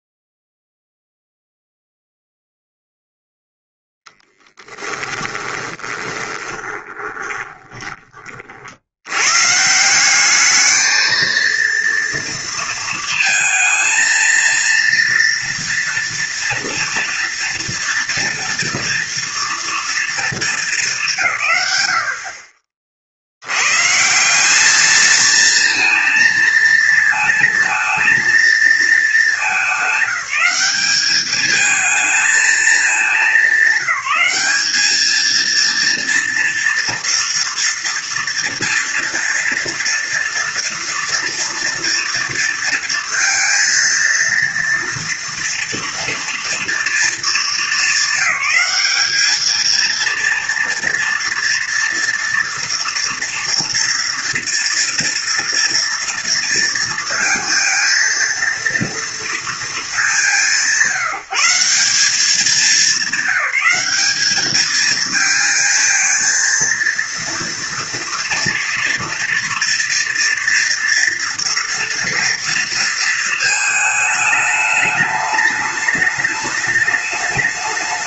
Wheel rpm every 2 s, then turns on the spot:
0, 0, 10, 20, 60, 210, 230, 230, 230, 230, 210, 40, 200, 230, 230, 200, 220, 210, 230, 240, 240, 230, 230, 230, 210, 230, 230, 230, 230, 230, 180, 200, 220, 230, 230, 230, 230, 210, 210.
4-8